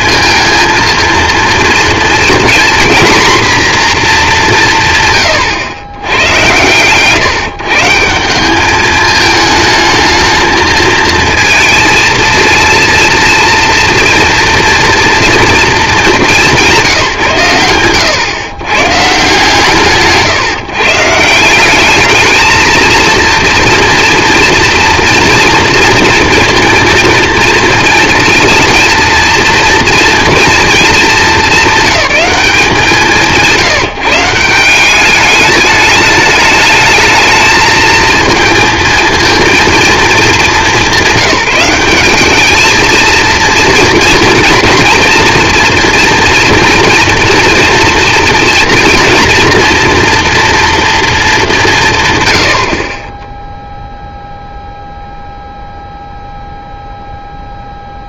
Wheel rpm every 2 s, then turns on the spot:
230, 230, 180, 120, 200, 220, 230, 240, 200, 130, 140, 220, 230, 230, 230, 230, 190, 180, 210, 230, 220, 210, 240, 230, 230, 230, 90, 0, 0.
none